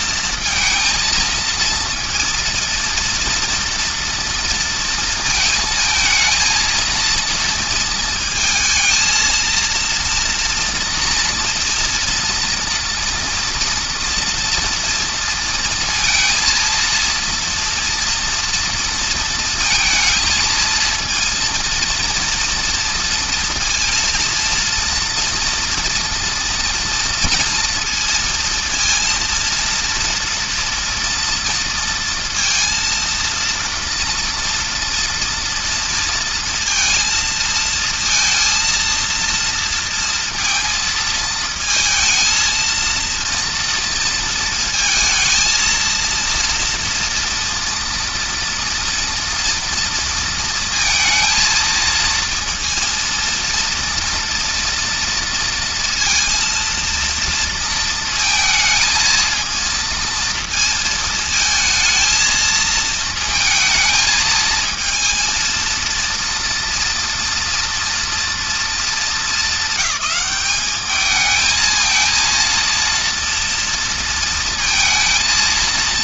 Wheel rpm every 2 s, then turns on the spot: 230, 230, 230, 230, 230, 230, 230, 230, 230, 230, 230, 230, 230, 230, 230, 230, 230, 240, 230, 230, 220, 230, 230, 230, 230, 230, 230, 230, 230, 220, 220, 220, 220, 240, 230, 210, 230, 230.
none